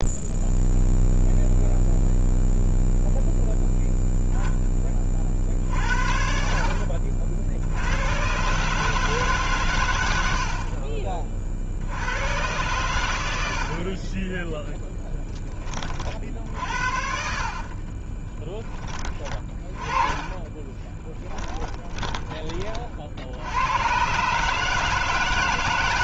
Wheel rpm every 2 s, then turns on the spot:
0, 0, 20, 60, 150, 40, 110, 10, 60, 10, 20, 50, 160.
10-12 16-18 20-22